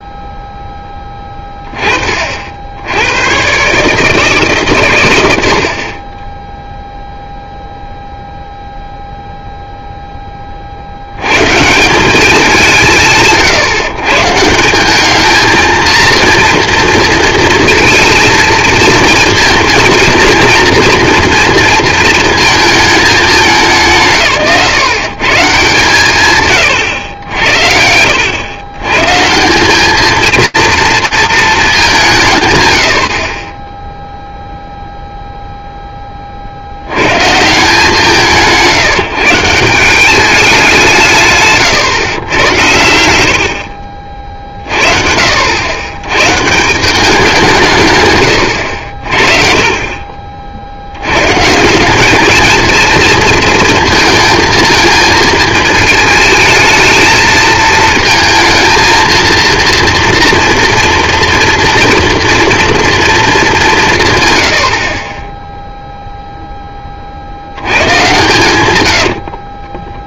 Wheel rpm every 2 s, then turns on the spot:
0, 60, 150, 10, 0, 30, 180, 160, 230, 220, 230, 220, 140, 120, 90, 230, 120, 0, 70, 160, 190, 90, 50, 170, 70, 80, 220, 220, 220, 220, 240, 230, 40, 40, 100.
42-44 68-70